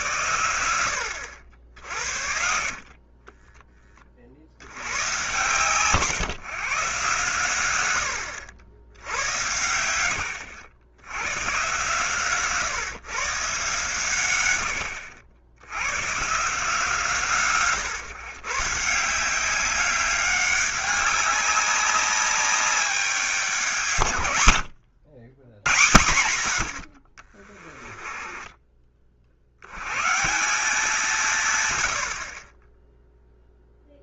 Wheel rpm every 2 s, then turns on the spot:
80, 50, 70, 140, 80, 80, 130, 100, 150, 150, 200, 190, 100, 80, 20, 170, 20.
2-4